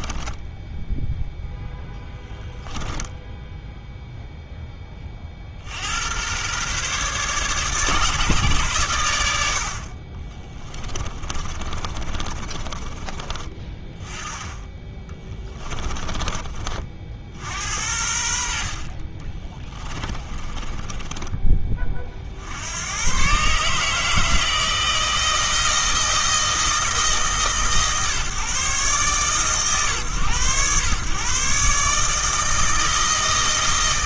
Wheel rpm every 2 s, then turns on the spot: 10, 10, 20, 130, 120, 20, 30, 20, 40, 50, 20, 90, 160, 150, 130, 110, 160.
0-2 10-14 18-22